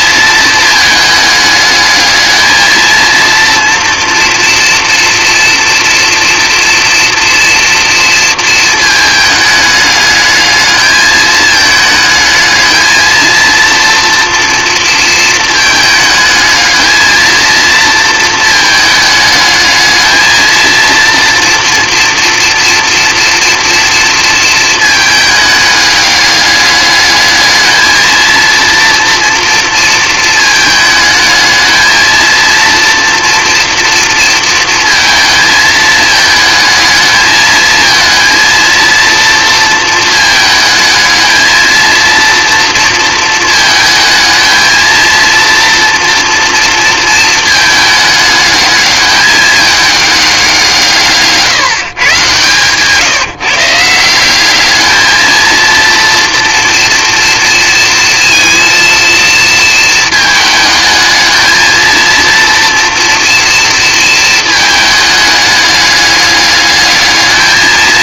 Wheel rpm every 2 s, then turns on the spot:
220, 220, 230, 230, 220, 220, 220, 230, 220, 220, 230, 230, 220, 210, 230, 220, 230, 230, 220, 230, 220, 230, 230, 230, 210, 160, 150, 210, 240, 230, 220, 240, 220, 210.
none